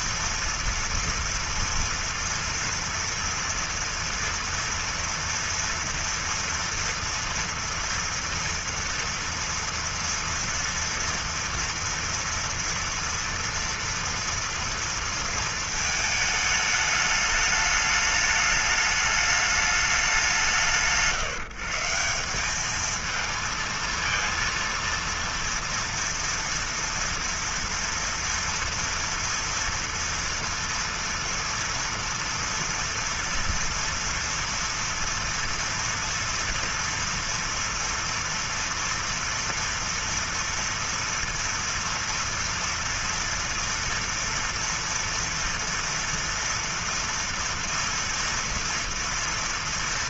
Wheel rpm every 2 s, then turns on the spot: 230, 230, 240, 230, 230, 230, 230, 230, 220, 210, 160, 190, 230, 240, 240, 230, 240, 230, 230, 230, 230, 230, 240, 230, 230.
none